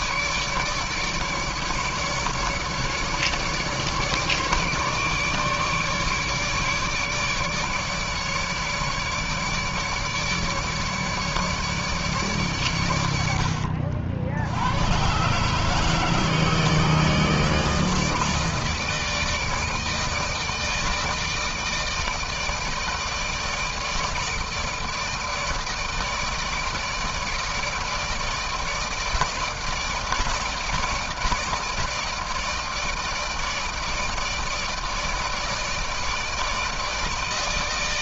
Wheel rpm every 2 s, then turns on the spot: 150, 150, 150, 150, 150, 150, 100, 110, 160, 160, 160, 160, 160, 160, 160, 160, 160, 160, 160.
none